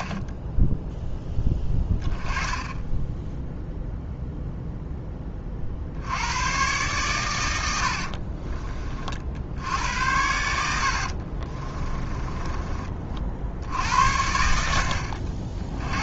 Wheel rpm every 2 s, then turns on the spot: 10, 10, 10, 120, 40, 70, 30, 70.
10-14